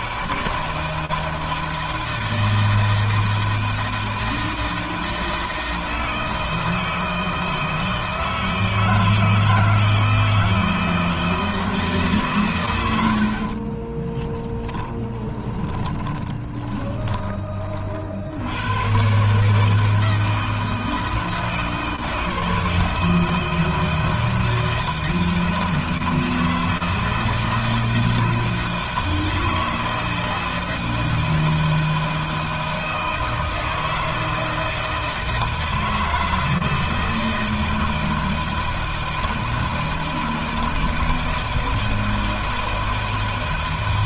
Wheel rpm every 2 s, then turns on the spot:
160, 160, 160, 160, 160, 160, 110, 10, 20, 110, 160, 160, 160, 160, 160, 160, 160, 160, 160, 160, 160, 160.
14-18